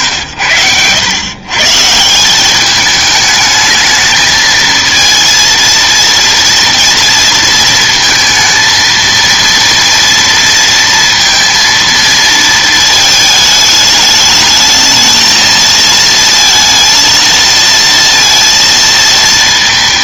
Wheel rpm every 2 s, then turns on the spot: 90, 190, 220, 230, 230, 230, 230, 220, 230, 230.
none